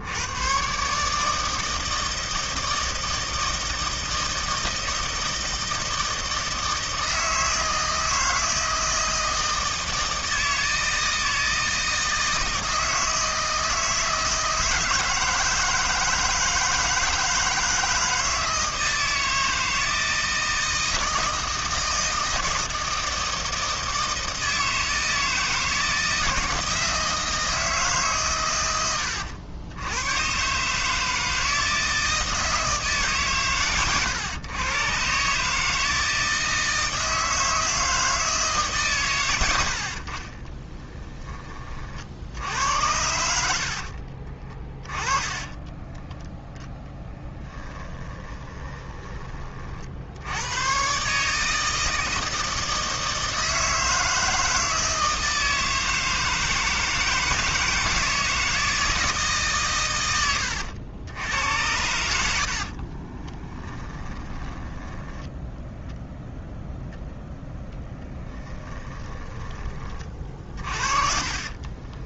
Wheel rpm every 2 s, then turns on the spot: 140, 160, 160, 160, 160, 160, 160, 160, 160, 160, 160, 160, 160, 160, 90, 150, 150, 130, 160, 150, 20, 80, 20, 10, 20, 120, 160, 160, 160, 160, 90, 40, 10, 0, 10, 40.
40-42 44-50 62-66 68-72